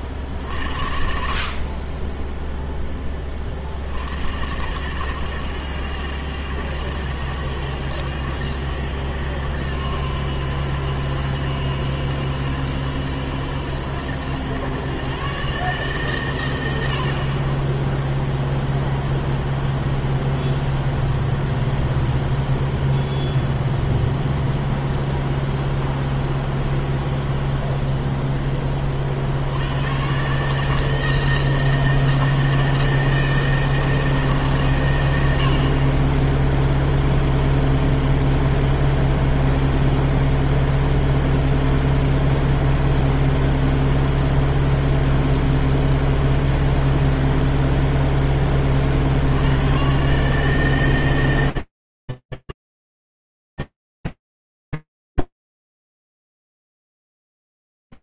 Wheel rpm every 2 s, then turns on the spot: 50, 0, 90, 100, 100, 90, 90, 110, 90, 0, 0, 0, 0, 0, 10, 150, 160, 130, 0, 0, 0, 0, 0, 0, 20, 140, 110, 60, 0.
none